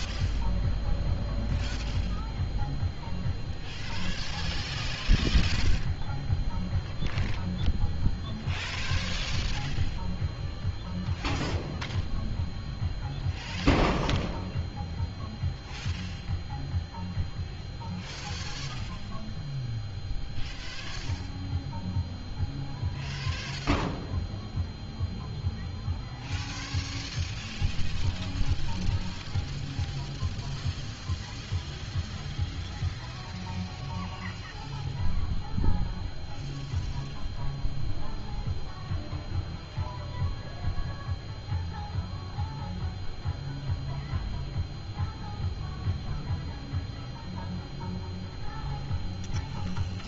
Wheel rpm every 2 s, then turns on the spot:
0, 0, 0, 0, 0, 0, 0, 0, 0, 0, 0, 0, 0, 0, 0, 0, 0, 0, 0, 0, 0, 0, 0, 0, 0.
none